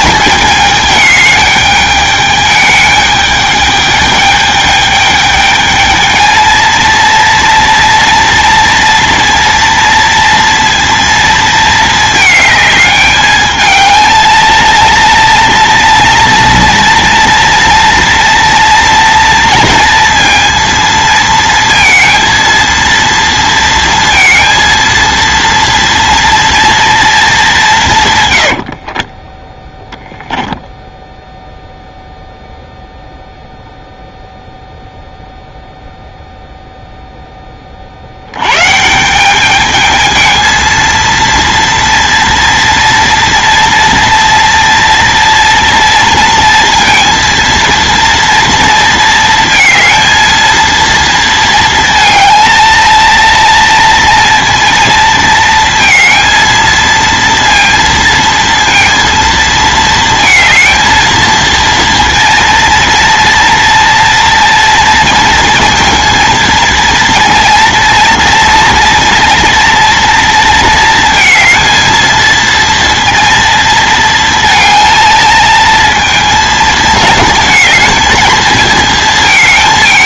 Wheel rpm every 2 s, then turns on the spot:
210, 210, 210, 230, 230, 230, 210, 230, 230, 230, 230, 230, 230, 230, 80, 0, 0, 0, 0, 130, 230, 240, 230, 230, 230, 230, 230, 230, 230, 230, 220, 230, 230, 230, 230, 230, 230, 230, 230, 220.
28-30